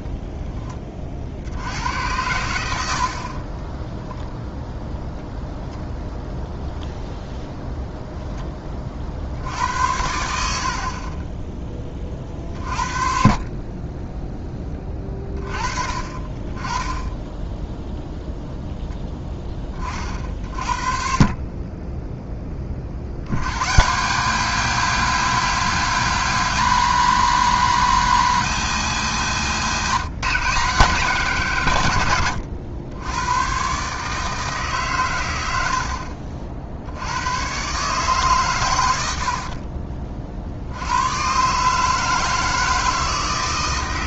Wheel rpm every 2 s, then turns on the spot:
30, 80, 0, 0, 30, 60, 40, 20, 20, 0, 50, 40, 190, 200, 180, 170, 90, 140, 70, 110, 80, 160.
none